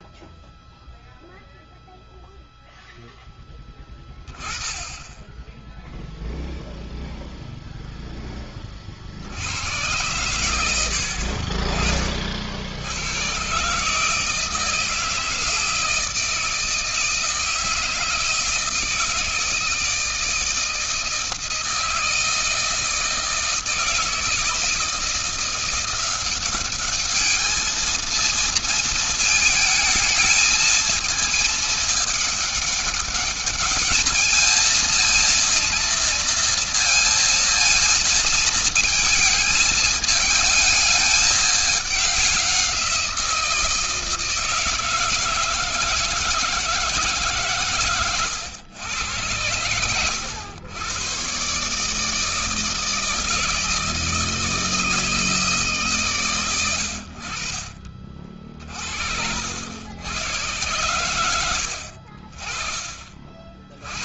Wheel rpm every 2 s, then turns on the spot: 0, 0, 10, 0, 20, 100, 60, 160, 160, 160, 160, 160, 170, 200, 220, 220, 210, 220, 230, 220, 220, 190, 160, 160, 110, 110, 160, 160, 110, 40, 110, 40.
10-12